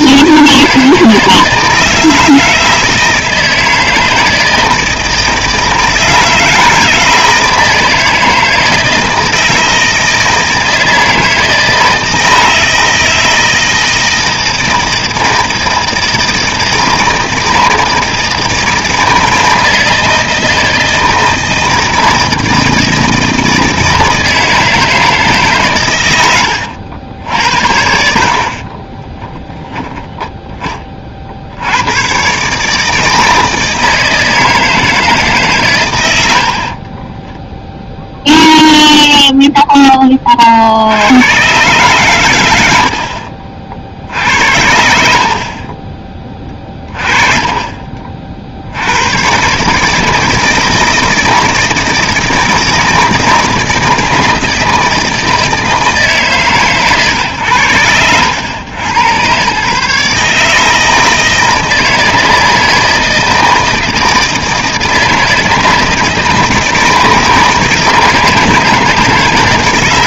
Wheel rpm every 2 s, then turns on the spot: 160, 160, 160, 160, 160, 160, 160, 160, 160, 160, 160, 160, 160, 90, 40, 20, 140, 160, 60, 0, 50, 90, 70, 20, 60, 160, 160, 160, 130, 100, 150, 160, 160, 160, 160.
28-30 36-38 44-48